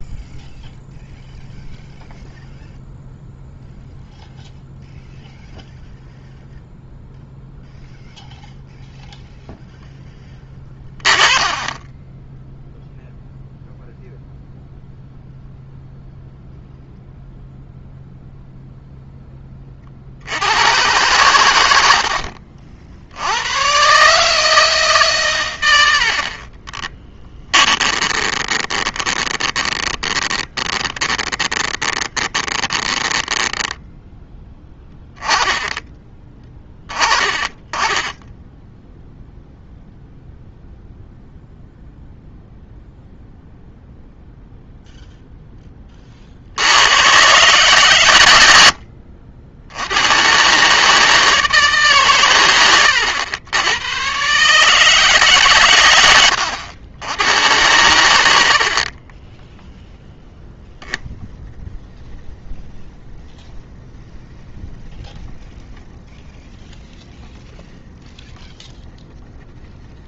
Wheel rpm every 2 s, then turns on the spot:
0, 0, 0, 0, 0, 20, 0, 0, 0, 0, 100, 60, 150, 20, 20, 20, 10, 10, 20, 0, 0, 0, 0, 80, 70, 140, 100, 150, 90, 60, 10, 10, 10, 10, 10.
10-12 26-34 48-50 58-60